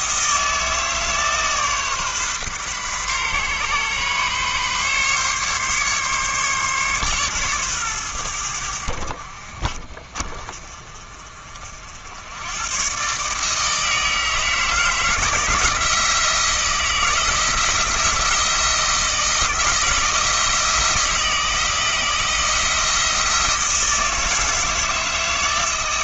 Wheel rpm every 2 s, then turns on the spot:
160, 130, 140, 140, 70, 40, 130, 160, 160, 170, 160, 170, 160.
none